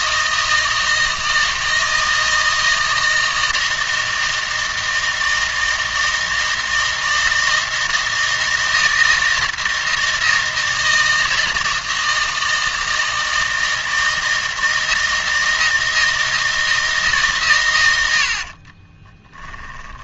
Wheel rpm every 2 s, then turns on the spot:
160, 160, 160, 160, 160, 160, 160, 160, 160, 30.
18-20